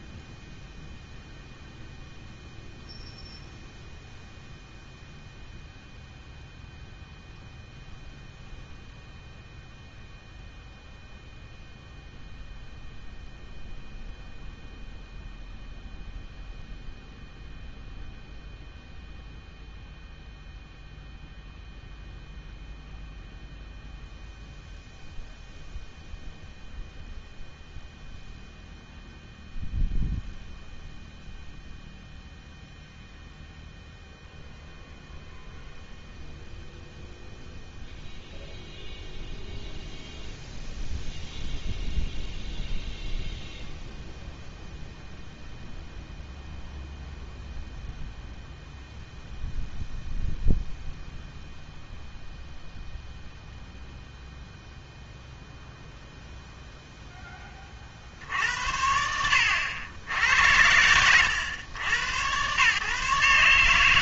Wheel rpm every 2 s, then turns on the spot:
0, 0, 0, 0, 0, 0, 0, 0, 0, 0, 0, 0, 0, 0, 0, 0, 0, 0, 0, 0, 0, 0, 0, 0, 0, 0, 0, 0, 0, 80, 80, 120.
none